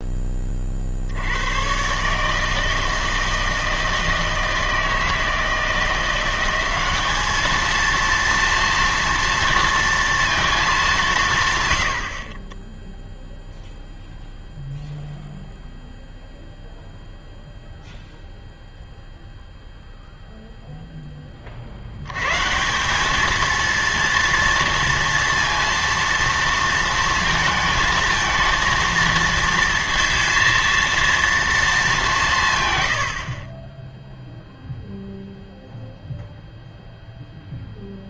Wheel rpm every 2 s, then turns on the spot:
40, 160, 160, 190, 230, 210, 10, 0, 0, 0, 0, 160, 230, 230, 230, 230, 140, 0, 0.
none